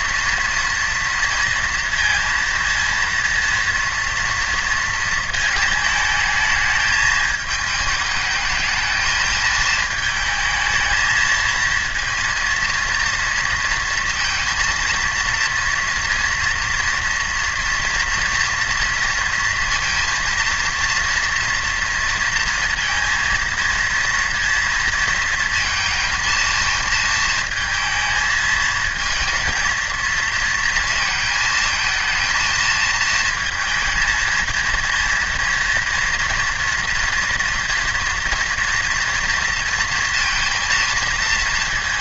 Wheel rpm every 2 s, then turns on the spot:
230, 230, 230, 220, 220, 220, 230, 230, 240, 240, 240, 230, 230, 220, 230, 230, 220, 230, 230, 230, 230.
none